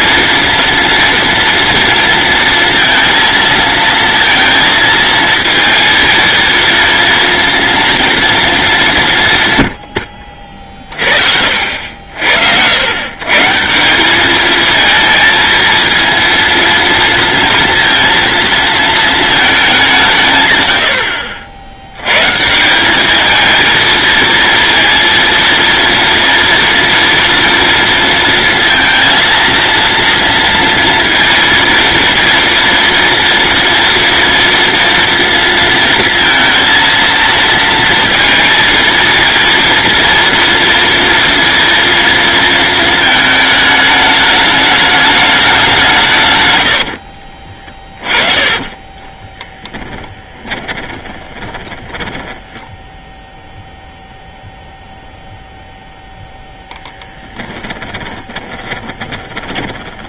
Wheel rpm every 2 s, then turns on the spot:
230, 230, 230, 230, 200, 40, 100, 220, 230, 220, 90, 180, 230, 230, 230, 230, 230, 230, 230, 230, 230, 220, 210, 90, 20, 20, 0, 0, 0, 20.
46-52 58-60